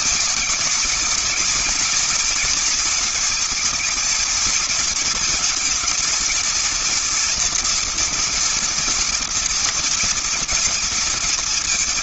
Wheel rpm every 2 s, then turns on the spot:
220, 230, 230, 230, 240, 230.
none